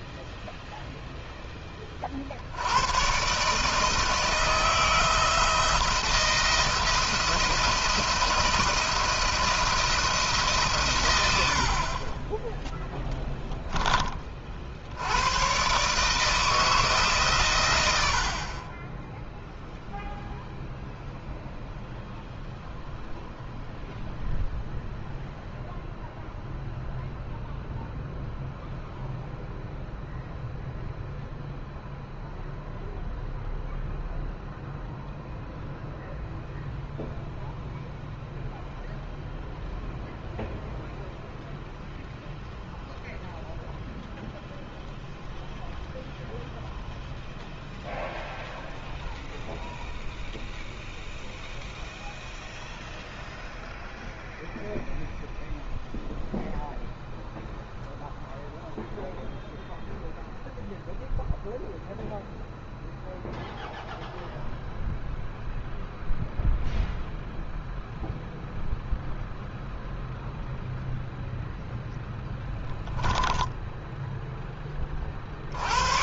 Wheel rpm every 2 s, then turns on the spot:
0, 90, 160, 160, 170, 130, 0, 60, 150, 30, 0, 0, 0, 0, 0, 0, 0, 0, 0, 0, 0, 0, 0, 0, 0, 0, 0, 0, 0, 0, 0, 0, 0, 0, 0, 0, 10, 20.
none